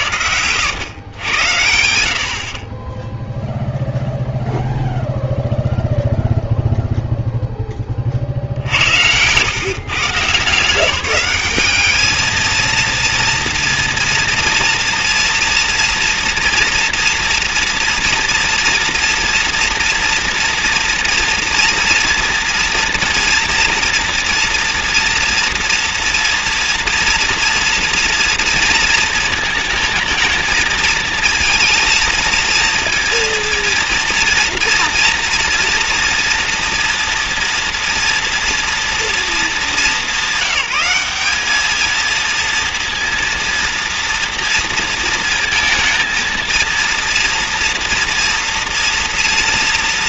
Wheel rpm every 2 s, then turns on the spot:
120, 10, 0, 0, 80, 170, 230, 230, 230, 230, 230, 230, 240, 230, 230, 230, 230, 230, 230, 240, 200, 230, 230, 230, 230.
none